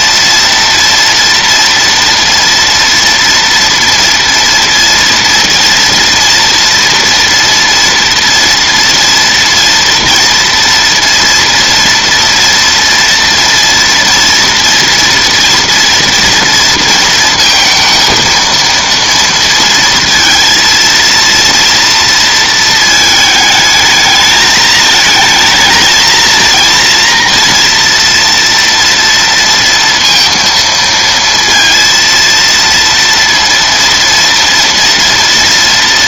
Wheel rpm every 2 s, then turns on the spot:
230, 230, 230, 230, 230, 230, 230, 230, 230, 230, 230, 220, 220, 230, 230, 230, 230, 230.
none